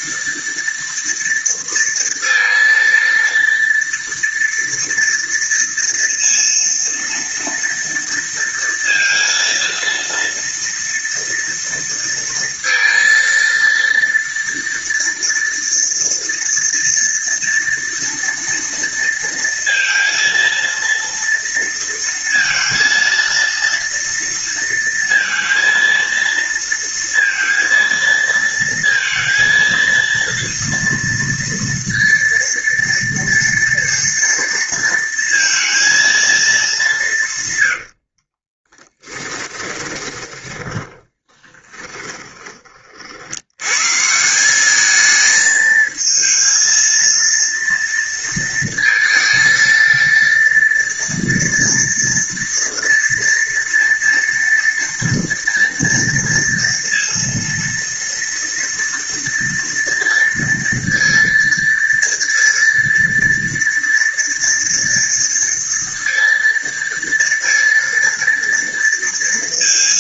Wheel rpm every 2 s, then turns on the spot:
230, 230, 230, 230, 230, 230, 230, 230, 230, 230, 230, 230, 230, 230, 230, 230, 230, 230, 230, 50, 20, 20, 170, 220, 230, 230, 230, 230, 240, 230, 230, 230, 230, 230, 230.
38-42